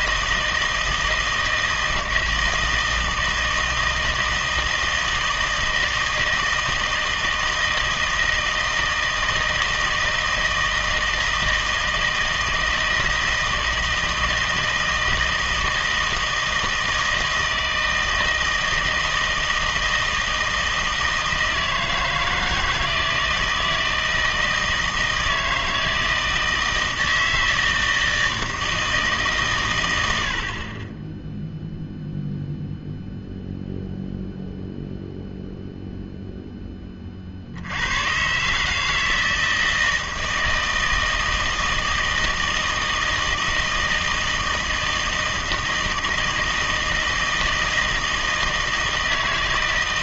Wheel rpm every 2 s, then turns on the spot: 160, 160, 160, 160, 160, 160, 160, 160, 160, 160, 160, 160, 160, 160, 160, 30, 0, 0, 20, 150, 160, 160, 160, 160, 160.
none